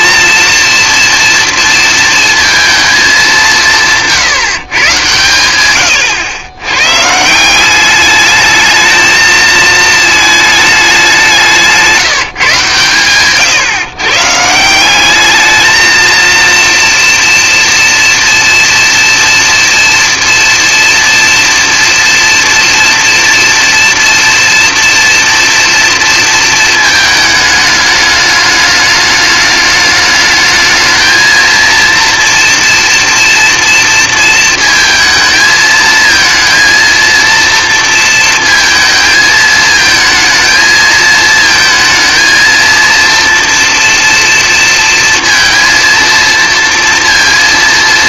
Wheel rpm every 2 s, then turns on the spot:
240, 230, 140, 120, 220, 210, 140, 170, 230, 230, 230, 230, 230, 220, 210, 220, 230, 230, 230, 230, 220, 230, 230, 230.
none